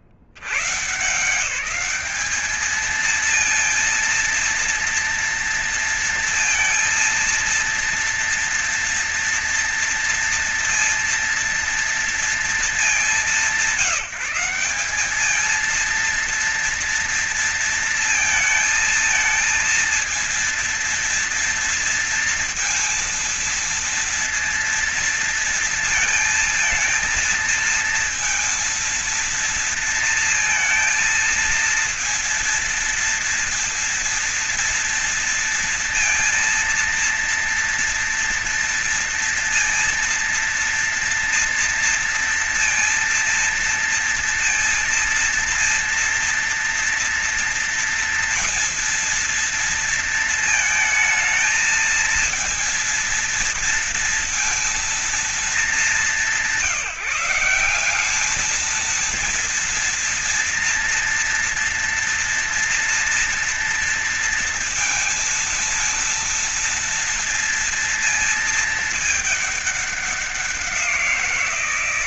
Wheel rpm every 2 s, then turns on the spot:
90, 210, 230, 230, 230, 230, 220, 180, 230, 220, 230, 230, 230, 220, 230, 230, 230, 230, 230, 230, 230, 230, 230, 230, 230, 230, 230, 230, 190, 200, 230, 240, 230, 230, 220, 190.
none